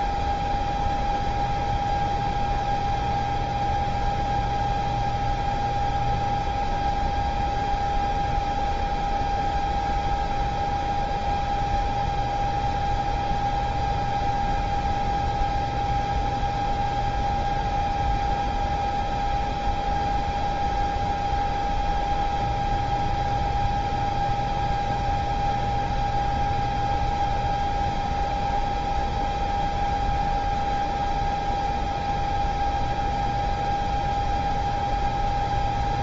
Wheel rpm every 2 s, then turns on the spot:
0, 0, 0, 0, 0, 0, 0, 0, 0, 0, 0, 0, 0, 0, 0, 0, 0, 0.
none